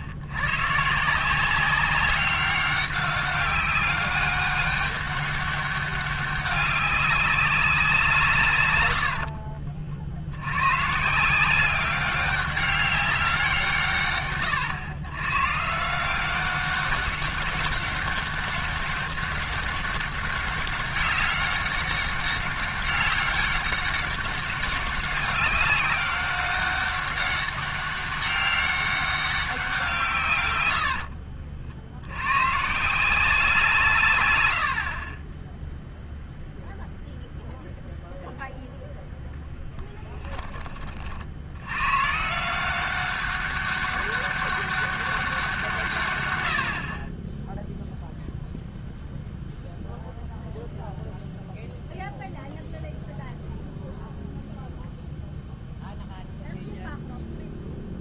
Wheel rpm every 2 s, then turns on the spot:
100, 200, 200, 200, 130, 130, 200, 120, 200, 200, 190, 200, 190, 200, 200, 80, 160, 60, 0, 0, 20, 180, 200, 90, 0, 0, 0, 0, 0.
30-32